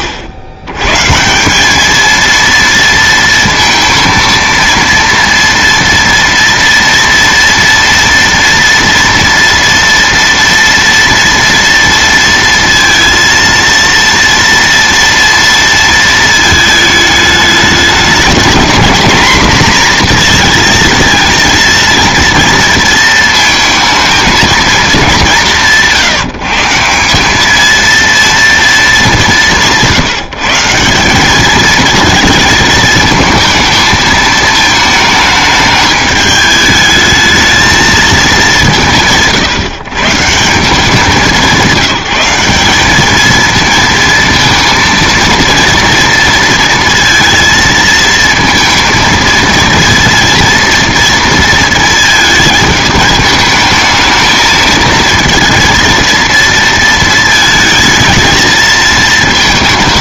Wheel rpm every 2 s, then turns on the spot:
100, 230, 230, 230, 230, 230, 230, 230, 220, 230, 220, 230, 220, 170, 220, 180, 220, 220, 210, 160, 180, 200, 230, 230, 230, 230, 210, 220, 230, 220.
none